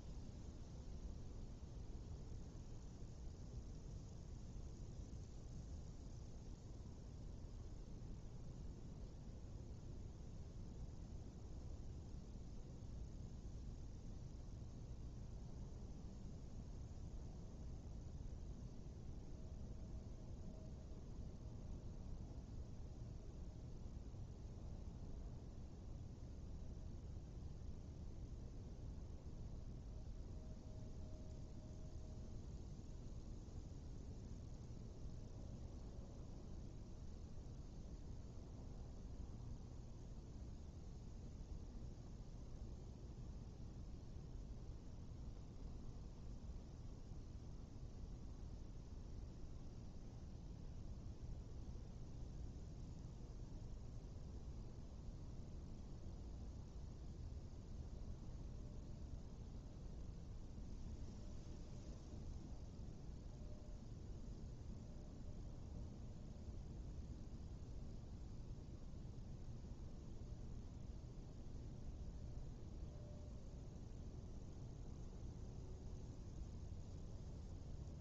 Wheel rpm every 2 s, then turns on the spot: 0, 0, 0, 0, 0, 0, 0, 0, 0, 0, 0, 0, 0, 0, 0, 0, 0, 0, 0, 0, 0, 0, 0, 0, 0, 0, 0, 0, 0, 0, 0, 0, 0, 0, 0, 0, 0, 0, 0.
none